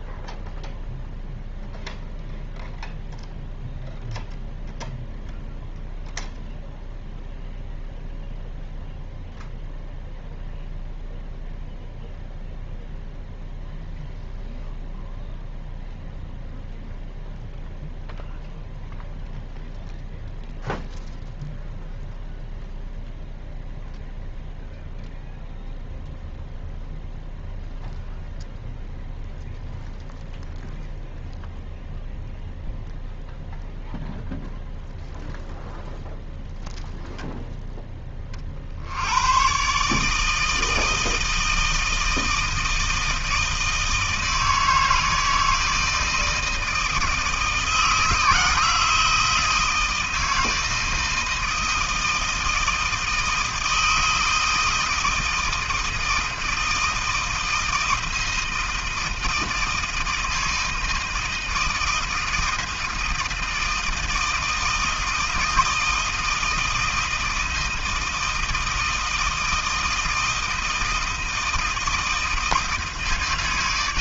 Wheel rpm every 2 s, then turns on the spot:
0, 0, 0, 0, 0, 0, 0, 0, 0, 0, 0, 0, 0, 0, 0, 0, 0, 0, 0, 60, 160, 160, 160, 160, 160, 160, 160, 160, 160, 160, 160, 160, 160, 160, 160, 160, 160.
none